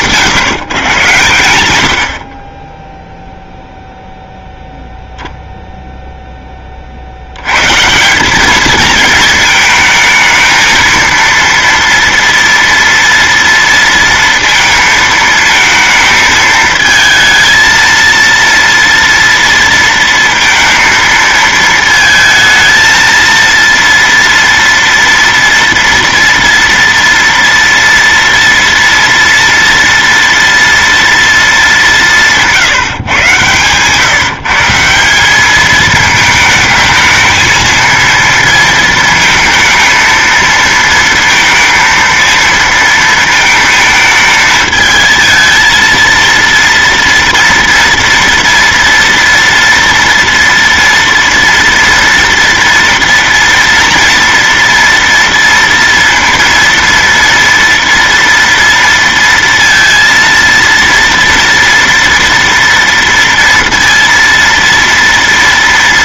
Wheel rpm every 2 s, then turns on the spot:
130, 10, 0, 60, 220, 230, 230, 220, 220, 230, 230, 230, 230, 230, 230, 230, 140, 180, 220, 230, 230, 230, 220, 230, 230, 230, 230, 230, 230, 230, 230, 230, 230.
none